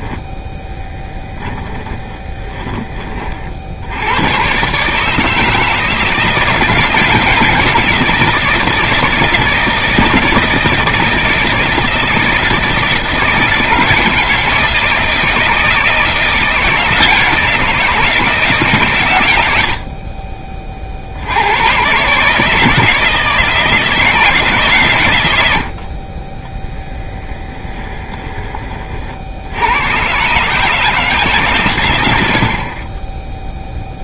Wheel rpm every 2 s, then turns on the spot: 10, 20, 140, 160, 160, 160, 160, 160, 170, 140, 50, 160, 130, 10, 40, 160, 50.
26-28 32-34